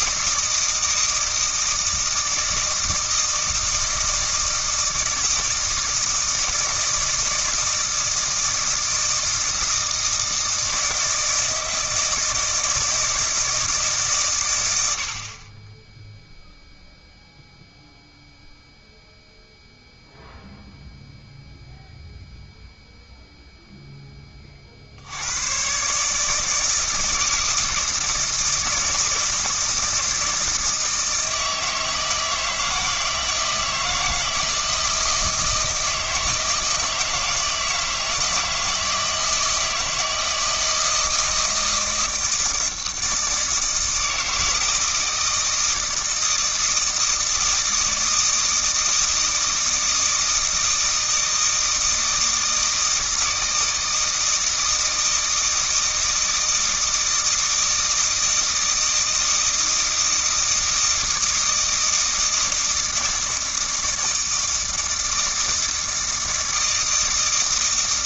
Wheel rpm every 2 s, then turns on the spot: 160, 160, 160, 160, 160, 160, 160, 90, 0, 0, 0, 0, 60, 160, 160, 160, 160, 160, 160, 160, 160, 160, 160, 160, 160, 160, 160, 160, 160, 160, 160, 160, 160, 160.
none